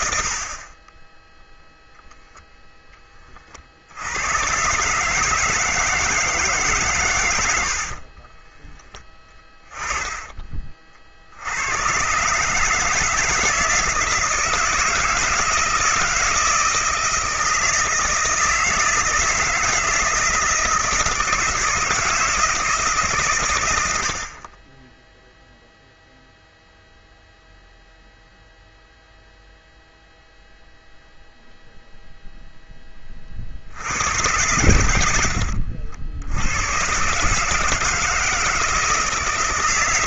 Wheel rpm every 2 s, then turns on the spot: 40, 0, 120, 150, 20, 30, 150, 170, 160, 160, 160, 160, 30, 0, 0, 0, 0, 100, 90, 160.
8-10